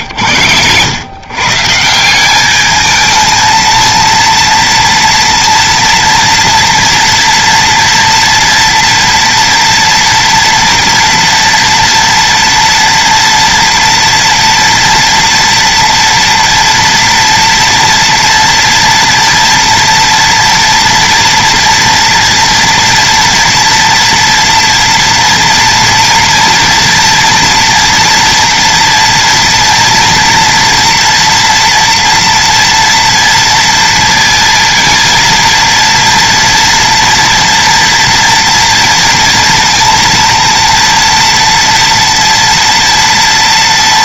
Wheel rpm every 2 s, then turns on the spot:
110, 190, 230, 230, 230, 230, 230, 230, 230, 240, 240, 230, 230, 230, 230, 230, 240, 230, 230, 230, 230, 230.
none